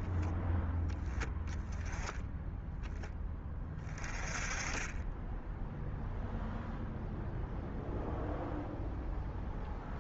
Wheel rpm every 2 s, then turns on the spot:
10, 10, 20, 0, 0.
none